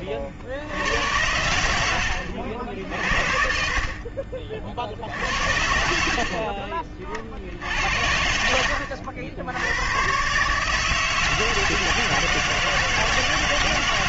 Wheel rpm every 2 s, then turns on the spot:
60, 70, 50, 20, 70, 140, 160.
none